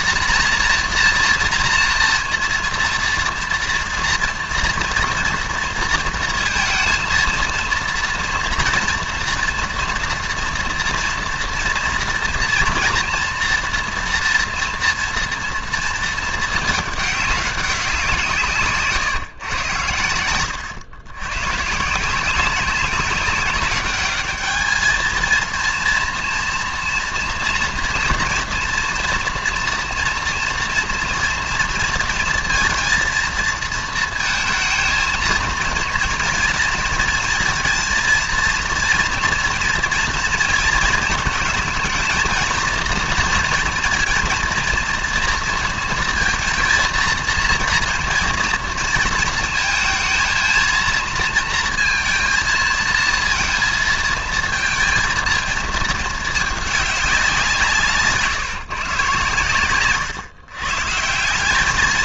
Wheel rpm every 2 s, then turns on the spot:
240, 230, 230, 230, 230, 230, 230, 230, 220, 150, 100, 190, 220, 240, 230, 230, 230, 220, 230, 230, 230, 230, 230, 230, 230, 230, 230, 230, 210, 150, 140.
none